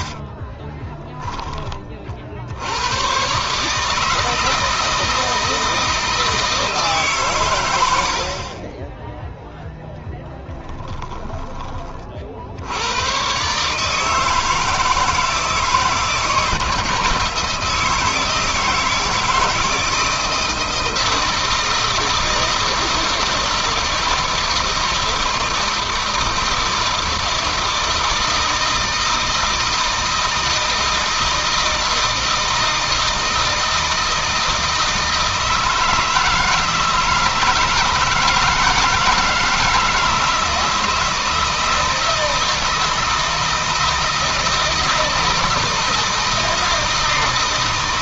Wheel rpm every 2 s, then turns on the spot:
10, 110, 160, 150, 10, 10, 90, 160, 160, 160, 170, 160, 160, 160, 160, 160, 160, 160, 160, 160, 160, 160, 160, 160.
0-2 10-12